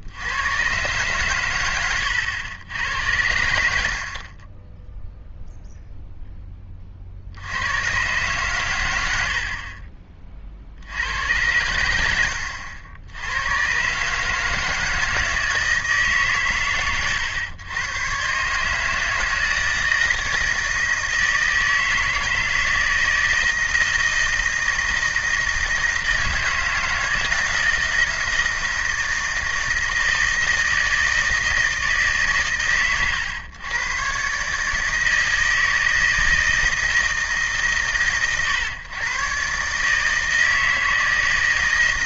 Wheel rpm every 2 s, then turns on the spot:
130, 90, 10, 30, 100, 80, 80, 160, 140, 150, 160, 160, 160, 160, 160, 160, 100, 160, 160, 120, 160.
none